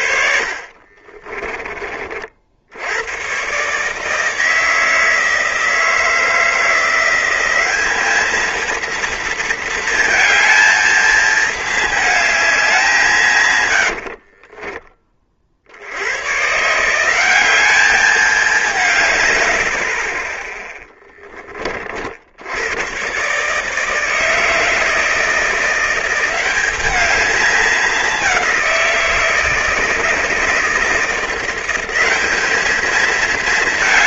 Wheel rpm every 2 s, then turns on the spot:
40, 80, 160, 170, 230, 220, 190, 20, 150, 170, 10, 100, 160, 200, 180, 160, 210.
0-2 20-22